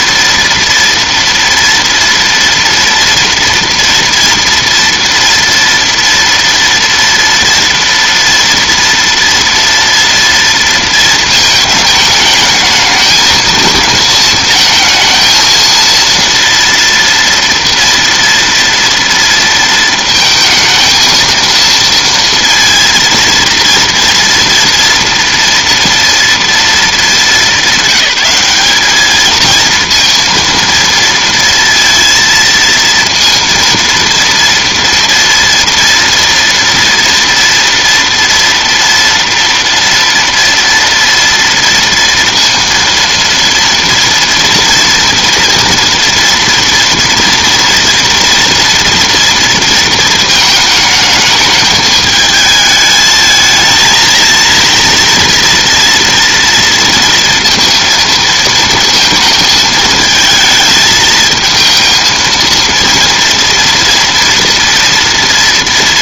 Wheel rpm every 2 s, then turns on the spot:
230, 230, 230, 230, 230, 230, 220, 220, 230, 230, 230, 230, 230, 220, 200, 230, 230, 230, 230, 230, 230, 230, 230, 230, 230, 220, 220, 230, 230, 220, 220, 230, 240.
none